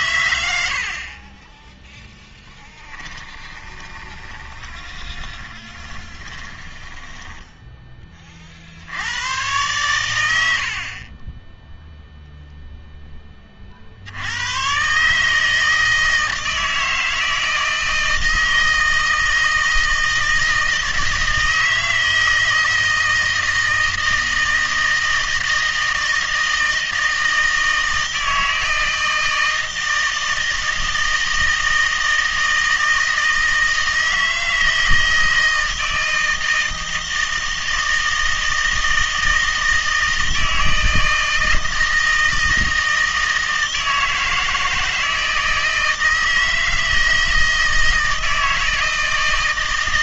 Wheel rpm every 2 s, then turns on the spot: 60, 10, 20, 20, 60, 60, 0, 130, 160, 160, 160, 160, 160, 160, 160, 160, 160, 160, 160, 160, 160, 160, 160, 160, 160.
0-8